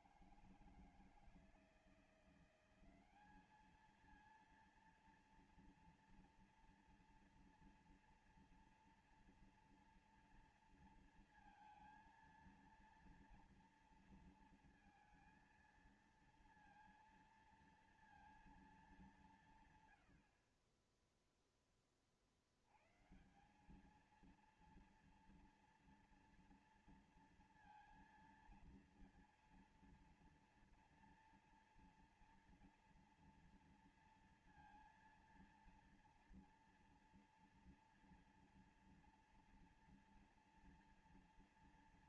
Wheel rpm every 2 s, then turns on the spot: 170, 180, 220, 230, 230, 230, 230, 230, 230, 230, 60, 60, 220, 230, 230, 230, 230, 230, 240, 230, 230.
none